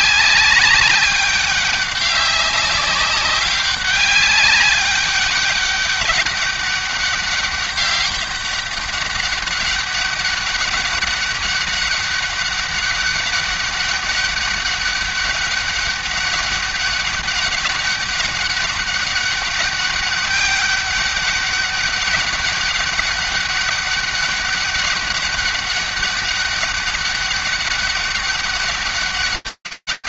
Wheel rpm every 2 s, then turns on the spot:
200, 200, 200, 200, 190, 200, 200, 200, 200, 200, 200, 200, 200, 200, 200.
none